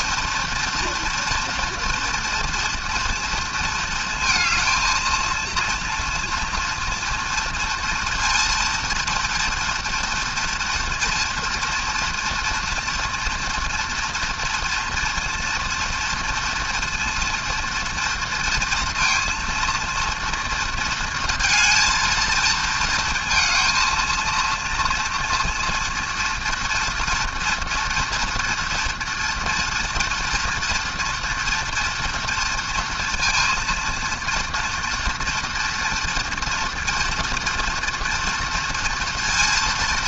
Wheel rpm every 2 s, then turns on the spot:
230, 230, 230, 240, 230, 230, 230, 230, 230, 230, 230, 230, 230, 240, 230, 230, 230, 230, 230, 230.
none